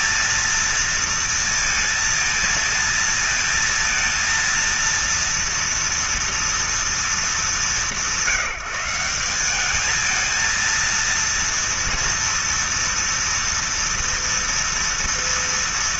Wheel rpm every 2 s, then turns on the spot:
230, 230, 230, 230, 180, 220, 230, 230.
none